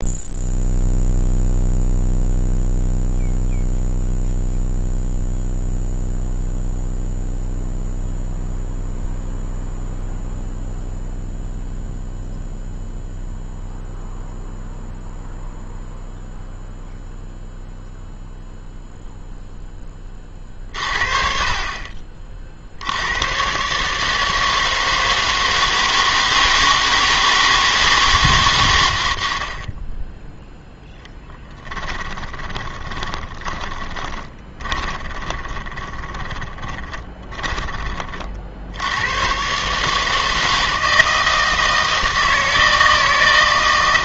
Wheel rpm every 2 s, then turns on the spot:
0, 0, 0, 0, 0, 0, 0, 0, 0, 0, 50, 60, 160, 160, 110, 0, 20, 20, 30, 70, 160, 160.
32-38